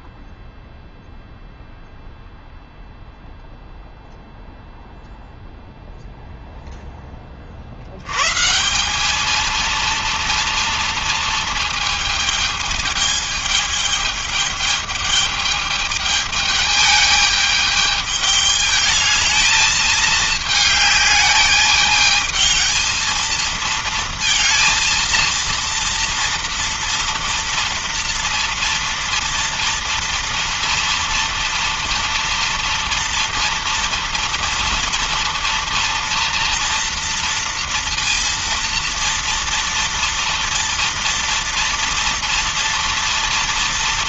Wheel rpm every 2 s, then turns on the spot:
0, 0, 0, 0, 140, 230, 220, 210, 210, 210, 210, 220, 230, 240, 240, 230, 230, 230, 240, 230, 230, 230.
none